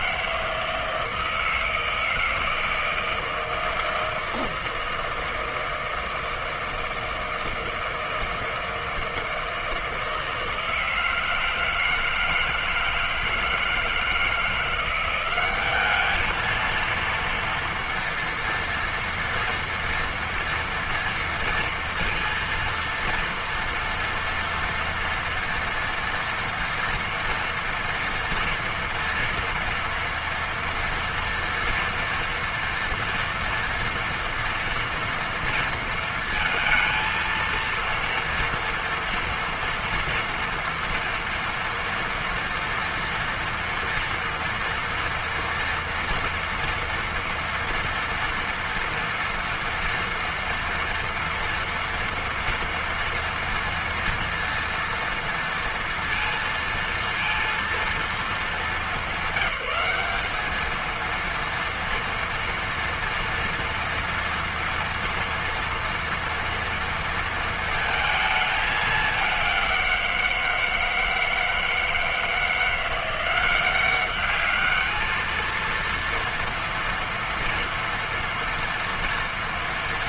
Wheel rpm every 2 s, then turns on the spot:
160, 160, 160, 160, 160, 160, 160, 170, 220, 230, 230, 230, 230, 230, 230, 240, 230, 230, 230, 230, 230, 230, 240, 230, 230, 240, 230, 230, 230, 210, 210, 230, 230, 230, 220, 160, 170, 210, 230, 230.
none